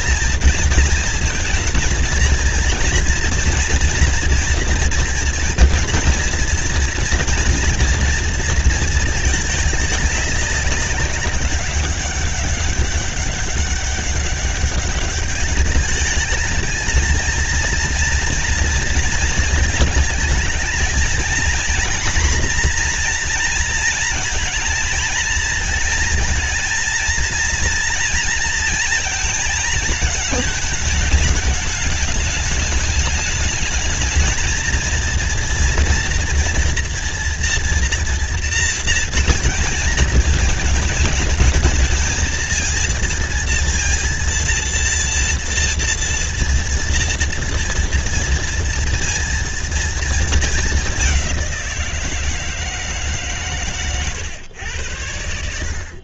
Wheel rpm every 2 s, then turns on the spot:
230, 230, 230, 230, 230, 200, 190, 200, 210, 230, 220, 230, 230, 230, 230, 220, 210, 230, 240, 230, 220, 230, 230, 230, 230, 210, 160, 100.
none